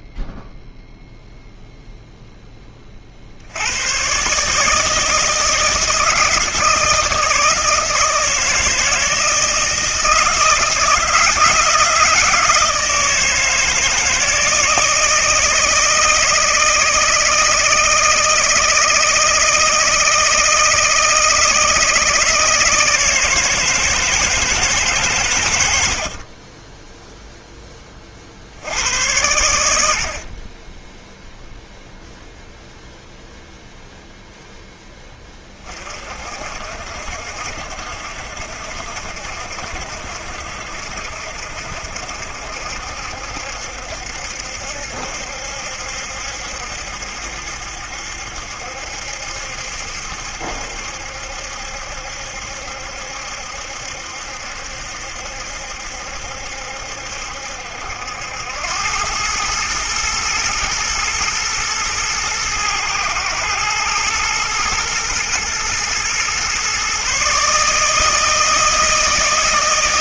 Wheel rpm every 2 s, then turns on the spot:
0, 20, 150, 160, 160, 160, 160, 160, 160, 160, 160, 160, 160, 20, 90, 20, 0, 0, 60, 70, 70, 70, 70, 70, 70, 70, 70, 70, 70, 90, 110, 110, 110, 130, 160.
none